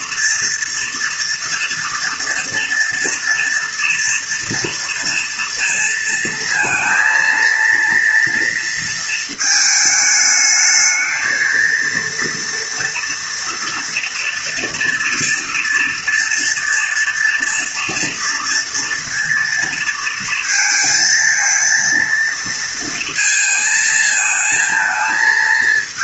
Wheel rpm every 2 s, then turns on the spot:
230, 230, 230, 230, 230, 220, 240, 230, 230, 230, 220, 230, 220.
none